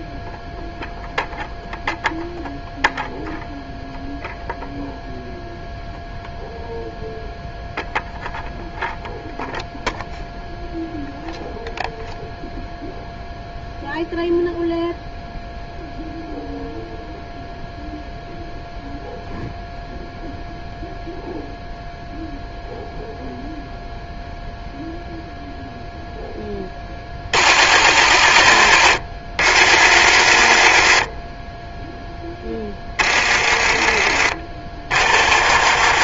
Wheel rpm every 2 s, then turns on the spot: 0, 0, 0, 0, 0, 0, 0, 0, 0, 0, 0, 0, 0, 30, 60, 50, 30, 40.
32-36